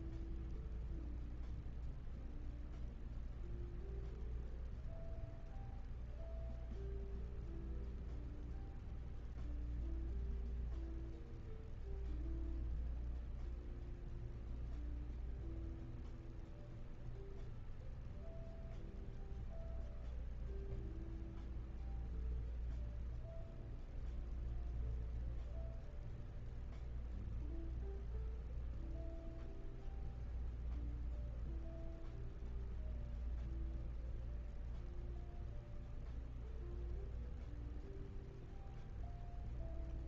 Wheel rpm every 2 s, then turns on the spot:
0, 0, 0, 0, 0, 0, 0, 0, 0, 0, 0, 0, 0, 0, 0, 0, 0, 0, 0, 0.
none